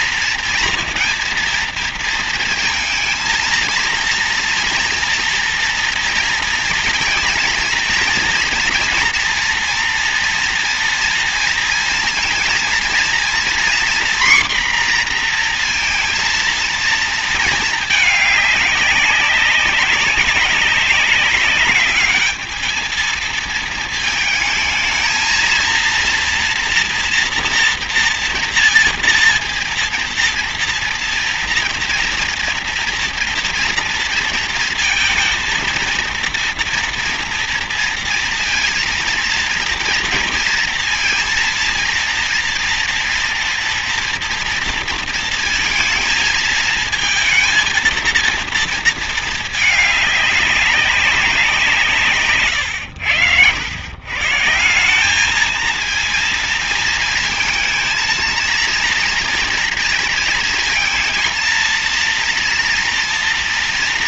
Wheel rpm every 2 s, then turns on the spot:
230, 230, 230, 230, 230, 230, 230, 250, 230, 200, 190, 220, 220, 230, 230, 230, 230, 230, 230, 230, 230, 230, 230, 220, 230, 200, 150, 150, 230, 230, 230, 230.
none